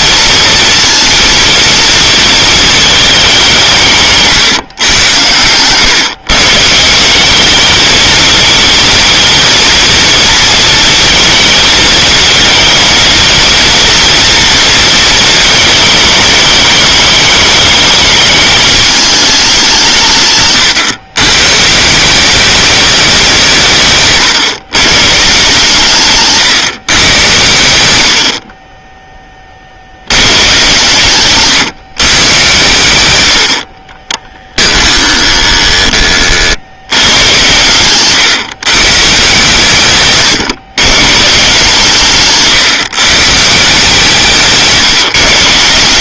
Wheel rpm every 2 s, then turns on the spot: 230, 220, 130, 150, 220, 230, 220, 230, 210, 220, 140, 200, 130, 130, 40, 110, 120, 30, 60, 140, 130, 150, 160.
20-22 34-36